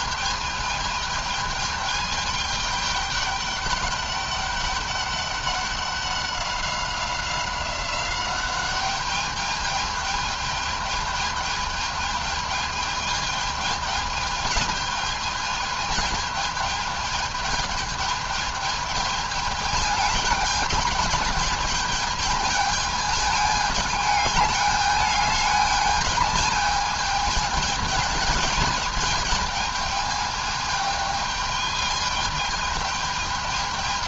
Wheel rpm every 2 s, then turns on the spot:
210, 210, 200, 190, 200, 210, 210, 210, 210, 210, 210, 210, 210, 210, 220, 210, 210.
none